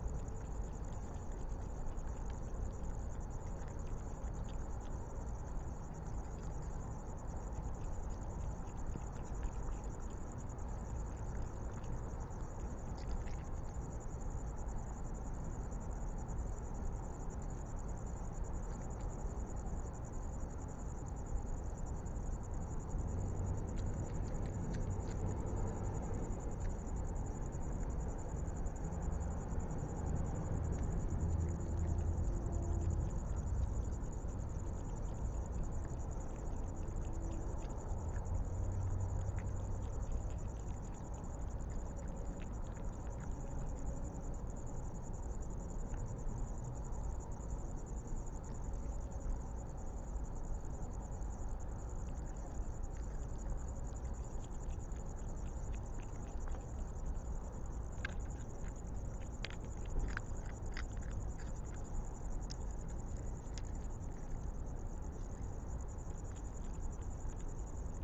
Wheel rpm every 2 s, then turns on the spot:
0, 0, 0, 0, 0, 0, 0, 0, 0, 0, 0, 0, 0, 0, 0, 0, 0, 0, 0, 0, 0, 0, 0, 0, 0, 0, 0, 0, 0, 0, 0, 0, 0, 0.
none